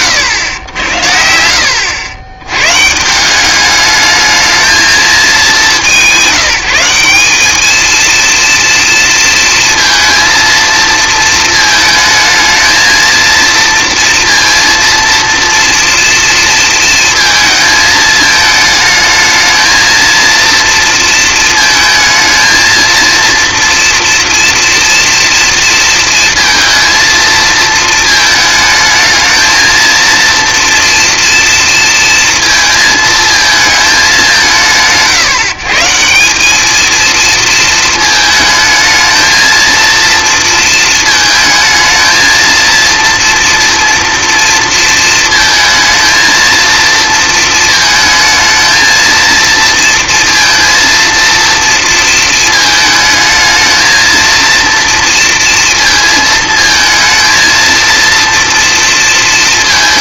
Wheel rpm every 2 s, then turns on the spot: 90, 120, 220, 180, 230, 230, 220, 230, 230, 220, 230, 230, 230, 230, 220, 240, 230, 120, 220, 220, 220, 230, 230, 230, 230, 230, 220, 230, 220, 230.
none